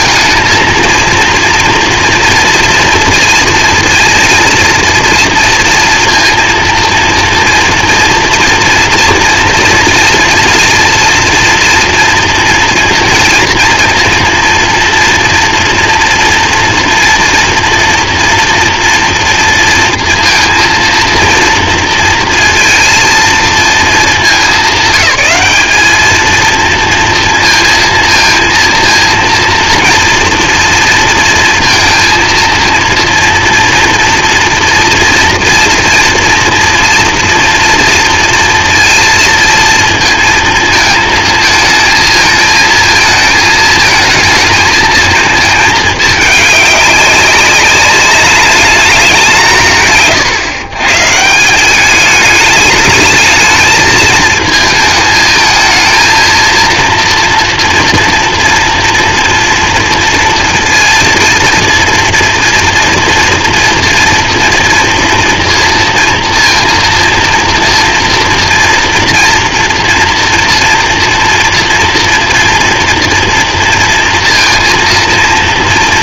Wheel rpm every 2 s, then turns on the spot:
230, 230, 230, 230, 230, 230, 230, 230, 240, 230, 230, 230, 200, 230, 230, 230, 230, 240, 230, 230, 220, 220, 220, 200, 210, 140, 210, 220, 230, 230, 230, 230, 230, 230, 230, 230, 230, 230.
none